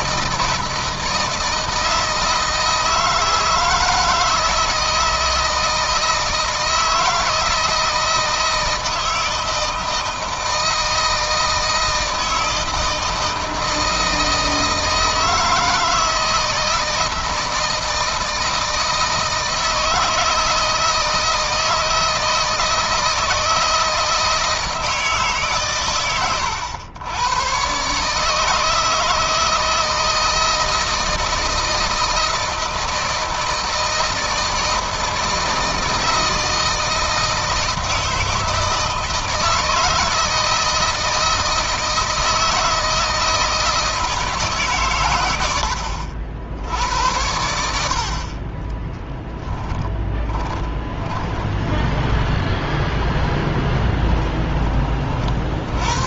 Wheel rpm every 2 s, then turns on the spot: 160, 160, 160, 160, 160, 160, 160, 160, 160, 160, 160, 160, 160, 90, 160, 160, 160, 160, 160, 160, 160, 160, 140, 70, 30, 20, 20, 20.
48-54